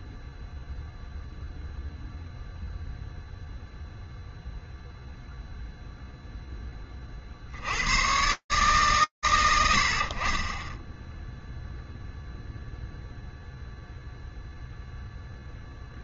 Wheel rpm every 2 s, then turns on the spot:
0, 0, 0, 100, 60, 0, 0, 0.
none